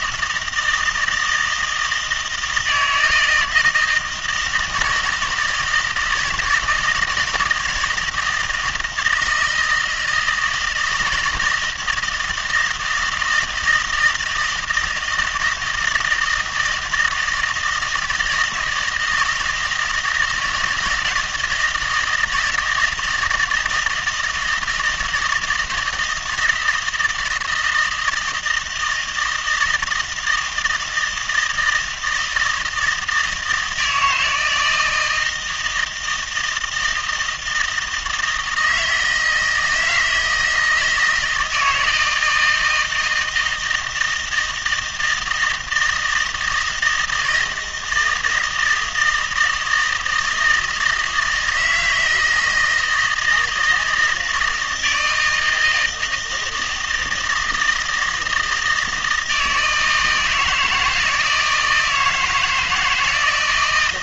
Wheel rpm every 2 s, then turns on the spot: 160, 160, 160, 160, 160, 160, 160, 160, 160, 160, 170, 160, 170, 160, 160, 160, 160, 160, 160, 160, 160, 160, 160, 160, 160, 160, 160, 160, 160, 160, 160, 160.
none